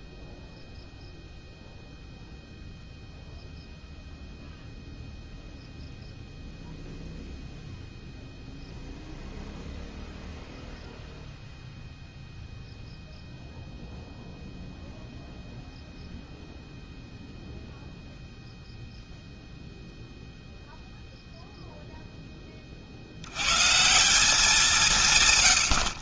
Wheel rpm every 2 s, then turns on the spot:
0, 0, 0, 0, 0, 0, 0, 0, 0, 0, 0, 30, 180.
none